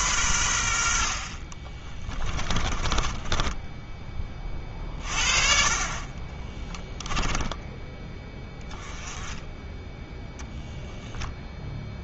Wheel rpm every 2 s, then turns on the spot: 80, 30, 40, 10, 10, 10.
2-4 6-8 10-12